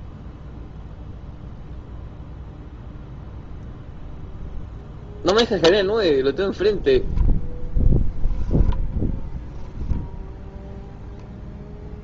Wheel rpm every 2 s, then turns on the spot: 0, 0, 0, 0, 20, 0.
8-10